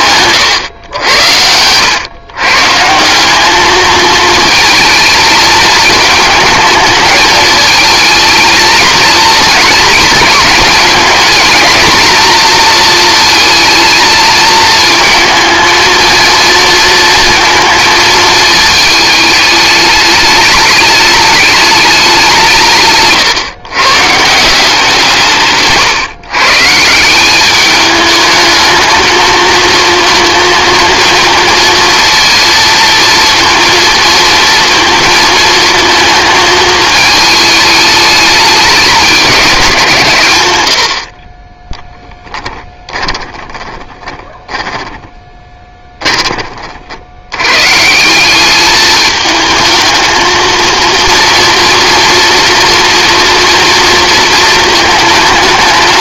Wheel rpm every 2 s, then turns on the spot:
100, 160, 220, 220, 220, 220, 230, 220, 230, 220, 210, 150, 170, 160, 220, 230, 230, 230, 220, 200, 70, 20, 10, 80, 210, 230, 230, 220.
42-46